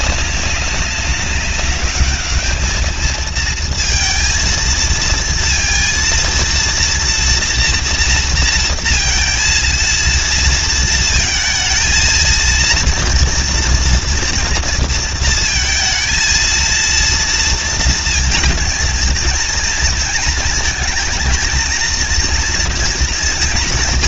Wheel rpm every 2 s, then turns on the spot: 200, 210, 230, 230, 230, 230, 230, 230, 230, 220, 230, 230.
none